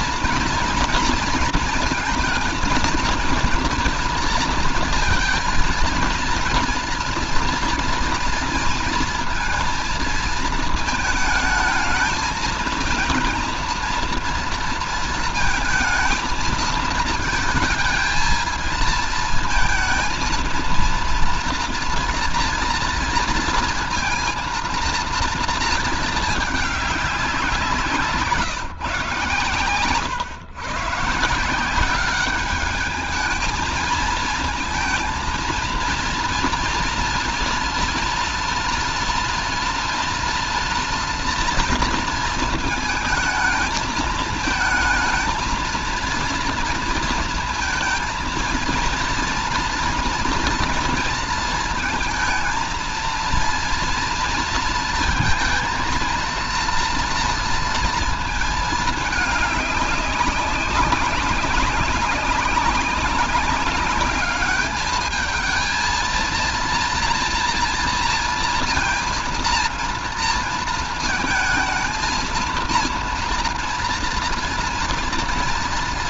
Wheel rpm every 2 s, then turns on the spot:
230, 230, 240, 230, 230, 230, 220, 230, 220, 230, 230, 230, 230, 220, 170, 140, 200, 230, 240, 240, 230, 220, 220, 230, 230, 240, 220, 230, 230, 230, 200, 190, 210, 230, 230, 230, 230, 230.
none